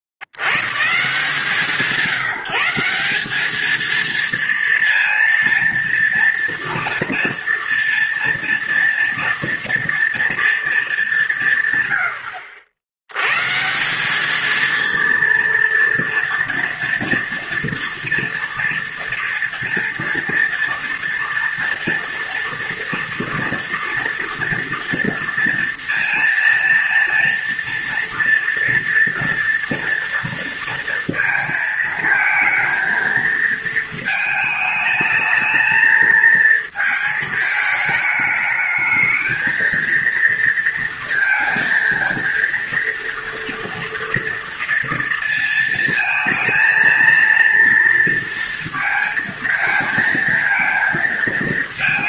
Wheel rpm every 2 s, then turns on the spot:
70, 180, 230, 240, 230, 220, 80, 230, 230, 230, 230, 230, 230, 230, 230, 230, 230, 220, 220, 210, 230, 230, 230, 230, 230, 220.
none